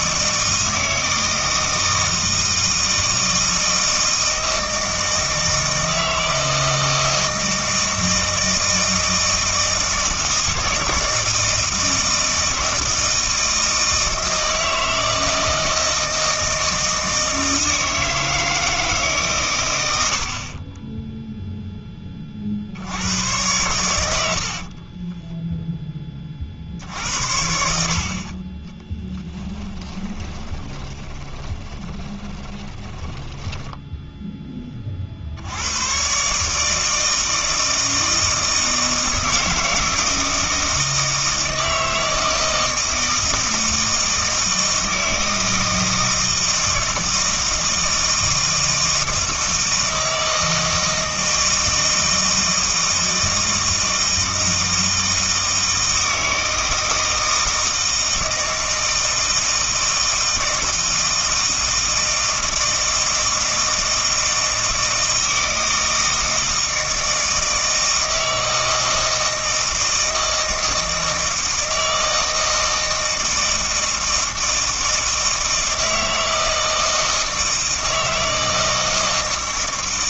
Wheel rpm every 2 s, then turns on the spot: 160, 160, 160, 160, 160, 160, 160, 160, 160, 160, 30, 60, 30, 60, 20, 20, 20, 20, 150, 160, 160, 160, 160, 160, 160, 160, 160, 160, 160, 160, 160, 160, 160, 160, 160, 160, 160, 160, 160, 160.
20-22 24-26 30-34